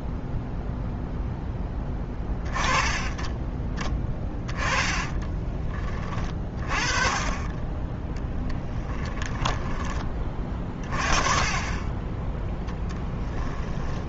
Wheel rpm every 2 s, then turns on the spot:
0, 20, 20, 30, 10, 30, 10.
4-6 8-10 12-14